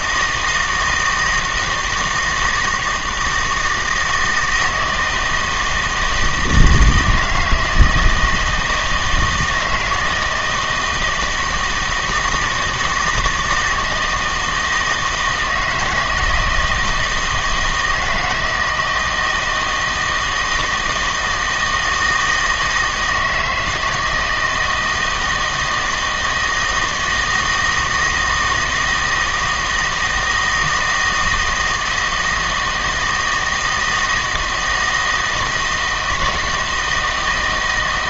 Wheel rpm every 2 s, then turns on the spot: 160, 160, 160, 160, 160, 160, 160, 160, 160, 160, 160, 160, 160, 160, 160, 160, 160, 160, 160.
none